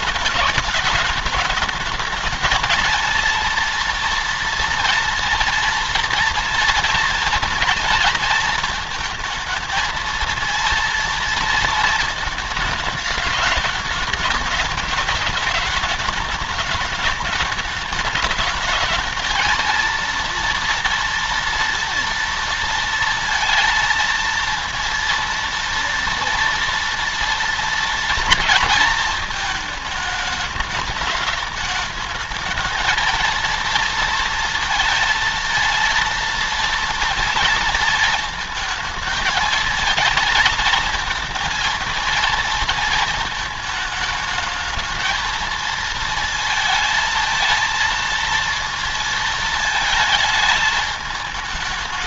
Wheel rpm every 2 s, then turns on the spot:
210, 230, 230, 230, 230, 230, 220, 210, 210, 210, 230, 230, 230, 230, 230, 210, 220, 230, 230, 220, 220, 230, 220, 230, 230, 220.
none